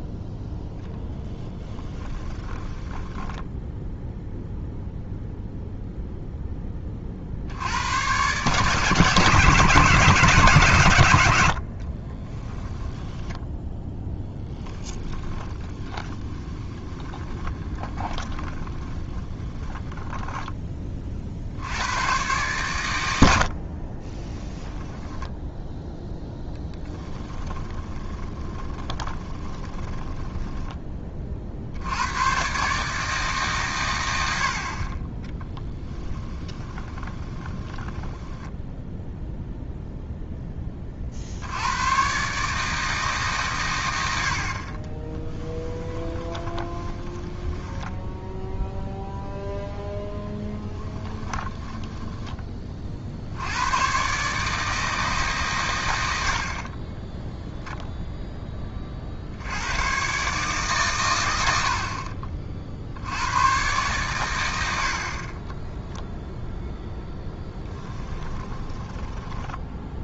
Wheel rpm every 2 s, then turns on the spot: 0, 10, 0, 20, 140, 140, 10, 10, 10, 20, 20, 110, 10, 10, 20, 20, 140, 40, 20, 10, 30, 160, 40, 20, 0, 20, 20, 160, 30, 30, 130, 60, 70, 0, 20.
2-4 12-20 26-30 36-40 44-48 50-52 68-70